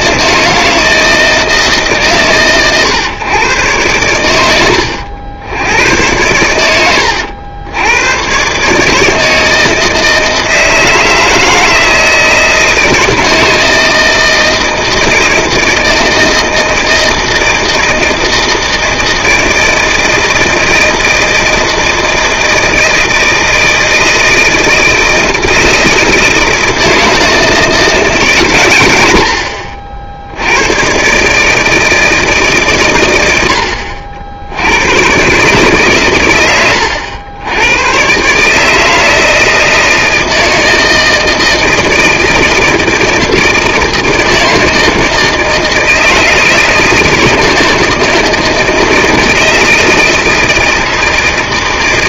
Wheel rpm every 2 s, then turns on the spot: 160, 130, 90, 100, 140, 160, 160, 160, 160, 160, 160, 160, 160, 160, 110, 100, 130, 90, 100, 150, 160, 160, 160, 160, 160, 160.
none